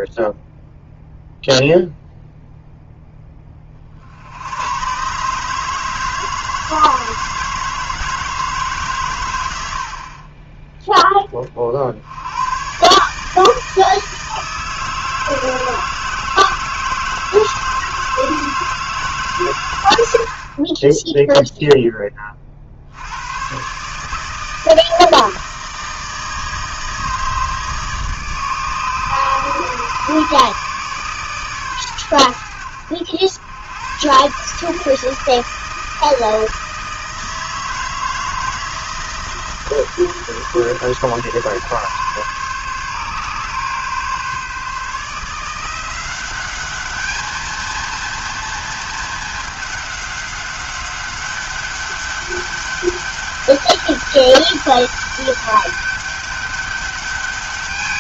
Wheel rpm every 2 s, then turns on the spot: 0, 30, 160, 160, 70, 40, 160, 160, 160, 130, 0, 110, 160, 150, 150, 130, 90, 160, 160, 160, 150, 140, 160, 210, 220, 200, 200, 200, 200.
none